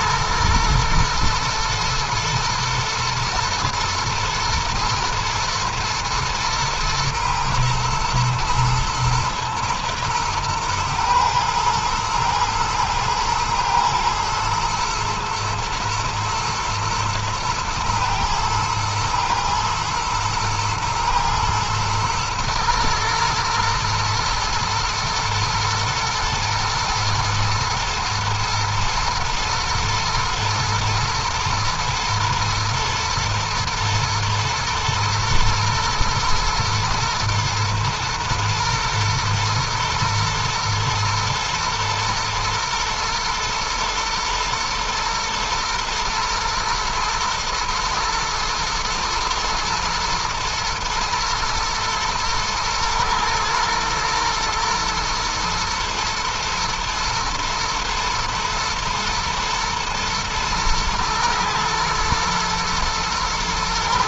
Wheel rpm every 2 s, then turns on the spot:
110, 110, 110, 110, 120, 110, 110, 110, 110, 110, 110, 120, 120, 110, 120, 120, 110, 120, 110, 110, 110, 120, 120, 120, 120, 120, 110, 110, 110, 110, 110, 110.
none